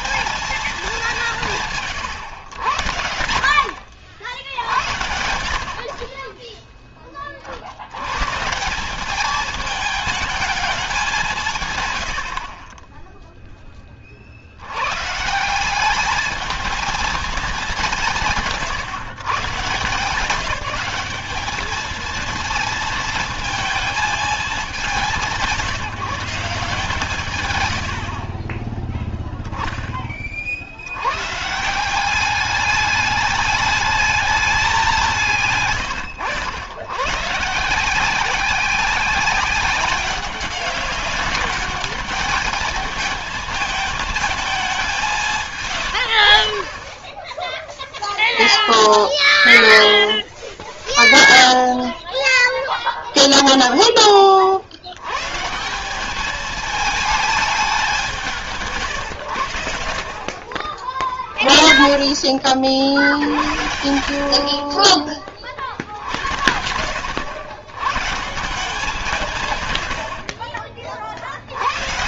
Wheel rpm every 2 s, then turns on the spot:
200, 100, 80, 20, 170, 210, 40, 100, 220, 140, 200, 220, 190, 150, 10, 70, 200, 190, 110, 190, 190, 210, 190, 30, 0, 0, 0, 70, 220, 130, 30, 50, 30, 90, 170, 50.
28-30